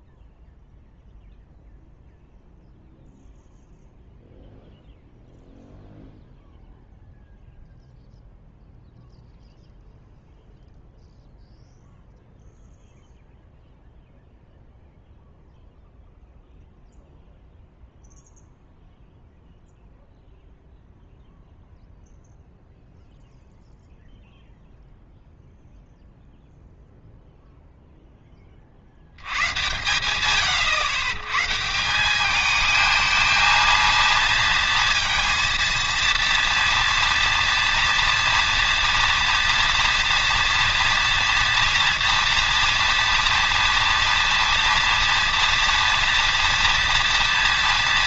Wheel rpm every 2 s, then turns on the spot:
0, 0, 0, 0, 0, 0, 0, 0, 0, 0, 0, 0, 0, 0, 60, 90, 220, 230, 230, 230, 240, 230, 230, 230.
none